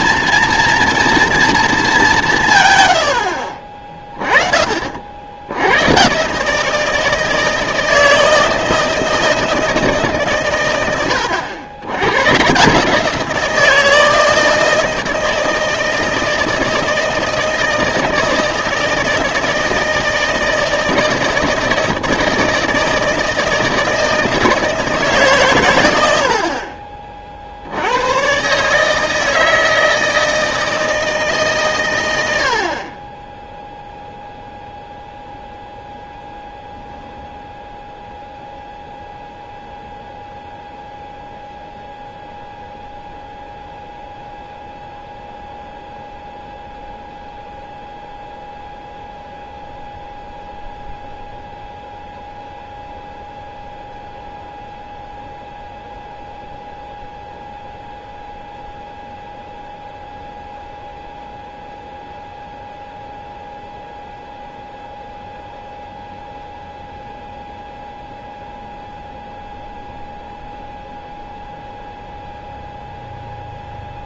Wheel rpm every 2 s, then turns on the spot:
230, 120, 40, 160, 160, 110, 150, 160, 160, 160, 160, 160, 160, 40, 150, 160, 50, 0, 0, 0, 0, 0, 0, 0, 0, 0, 0, 0, 0, 0, 0, 0, 0, 0, 0, 0, 0.
none